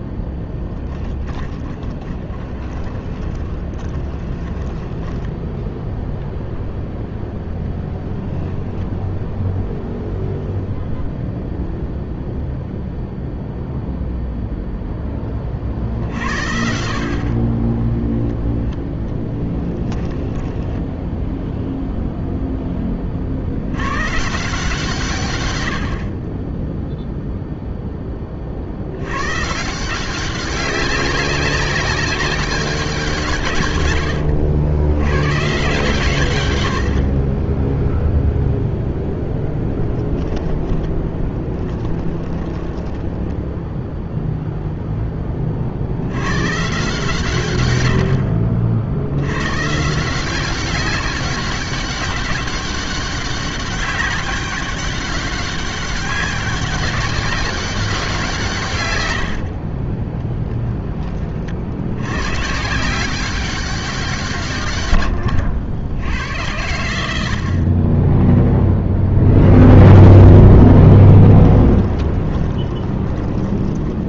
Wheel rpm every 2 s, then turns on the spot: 20, 30, 10, 0, 0, 0, 0, 30, 30, 10, 0, 40, 130, 0, 100, 200, 170, 110, 50, 0, 10, 10, 0, 140, 60, 190, 200, 190, 200, 140, 10, 170, 100, 100, 0, 0, 20.
0-6 18-20 40-44 58-60 72-74